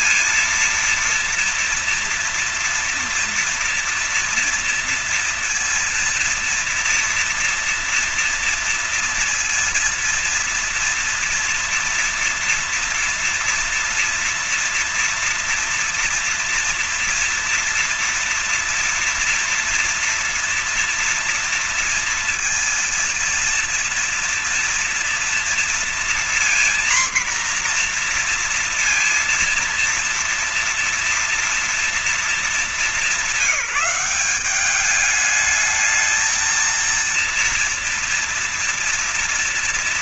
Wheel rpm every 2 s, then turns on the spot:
230, 230, 230, 230, 230, 230, 230, 230, 230, 230, 230, 230, 230, 240, 240, 230, 220, 190, 220, 230.
none